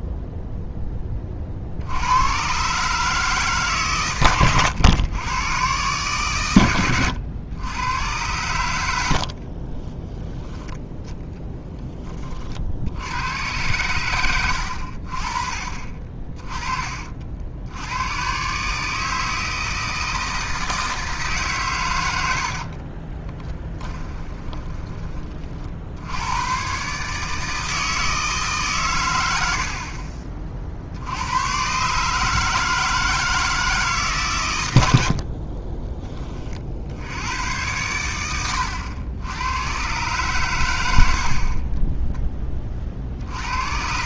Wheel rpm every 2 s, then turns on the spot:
0, 120, 120, 110, 100, 10, 50, 80, 30, 140, 160, 60, 20, 110, 150, 40, 160, 110, 40, 90, 110, 30.
22-26